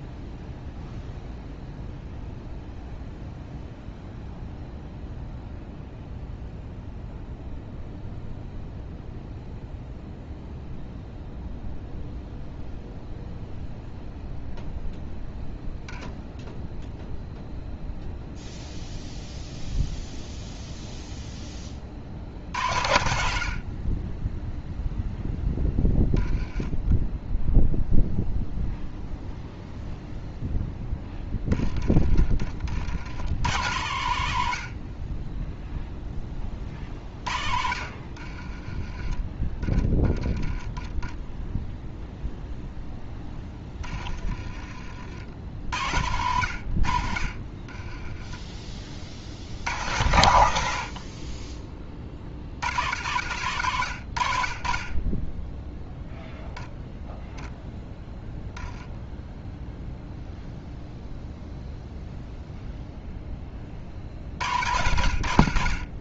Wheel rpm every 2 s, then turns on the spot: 0, 0, 0, 0, 0, 0, 0, 0, 0, 0, 0, 70, 0, 10, 0, 10, 70, 40, 40, 30, 10, 0, 60, 70, 30, 70, 70, 40, 0, 10, 0, 0, 60.
38-40